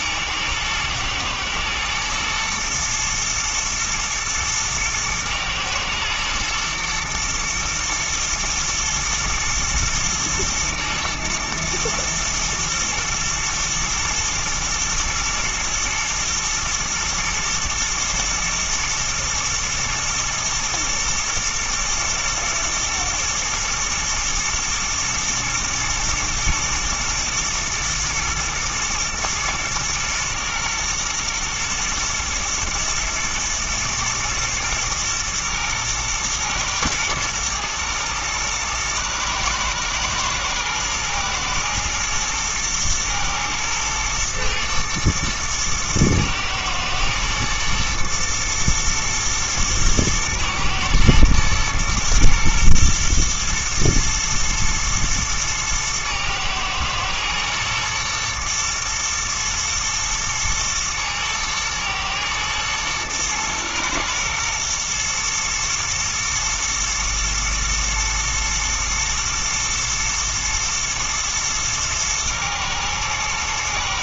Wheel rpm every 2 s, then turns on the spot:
110, 120, 110, 120, 120, 110, 110, 120, 110, 110, 110, 120, 120, 110, 120, 120, 120, 120, 110, 110, 110, 110, 110, 110, 110, 110, 120, 120, 110, 120, 110, 110, 110, 120, 110, 120, 120.
none